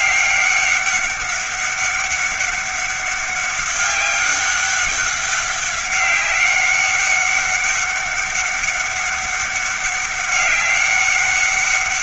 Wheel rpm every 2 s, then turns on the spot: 200, 200, 200, 190, 200, 200.
none